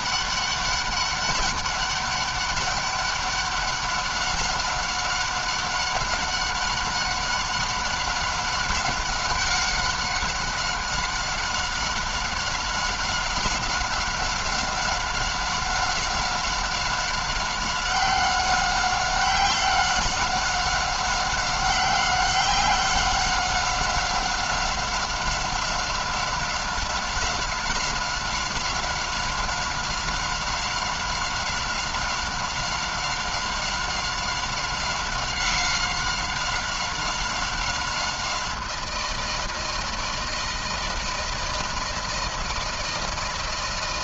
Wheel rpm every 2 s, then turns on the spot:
200, 200, 190, 190, 190, 190, 190, 190, 190, 190, 190, 190, 190, 190, 190, 190, 190, 190, 190, 180, 170, 160.
none